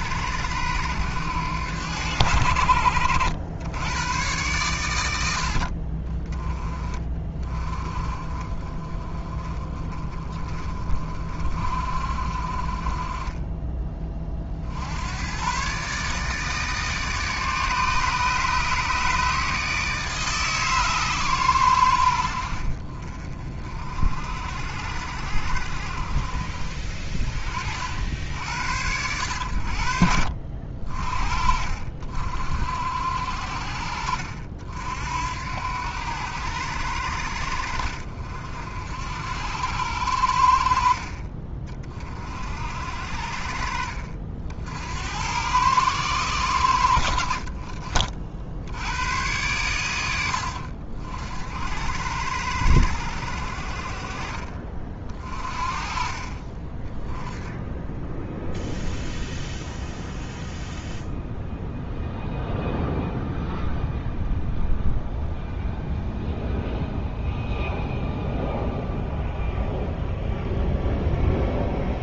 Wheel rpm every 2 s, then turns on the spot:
90, 70, 100, 30, 20, 30, 30, 70, 150, 150, 140, 50, 60, 40, 90, 50, 50, 60, 80, 60, 40, 50, 70, 80, 80, 60, 80, 40, 20, 0, 0, 0, 0, 0, 0, 0.
none